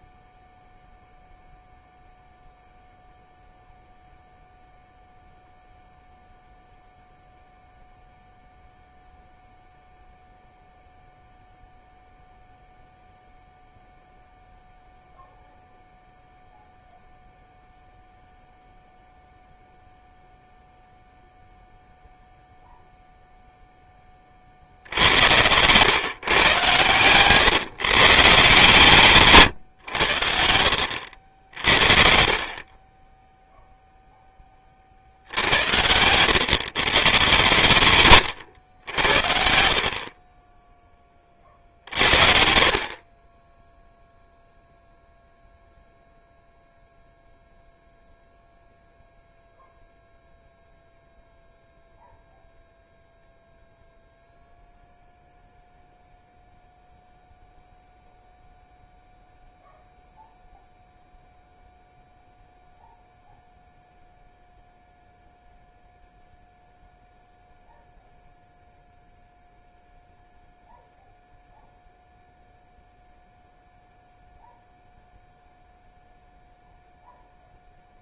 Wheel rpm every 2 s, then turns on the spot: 0, 0, 0, 0, 0, 0, 0, 0, 0, 0, 0, 0, 60, 120, 140, 70, 40, 20, 130, 110, 10, 50, 0, 0, 0, 0, 0, 0, 0, 0, 0, 0, 0, 0, 0, 0, 0, 0, 0.
none